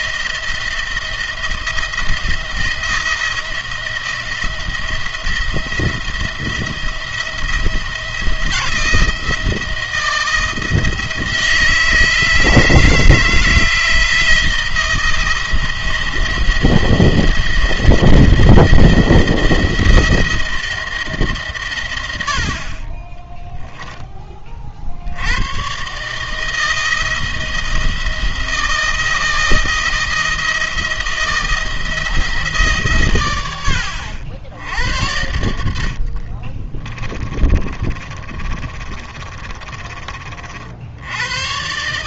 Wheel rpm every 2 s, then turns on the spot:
170, 170, 170, 170, 170, 160, 160, 170, 170, 170, 170, 50, 40, 160, 170, 170, 150, 80, 30, 30, 60.
36-40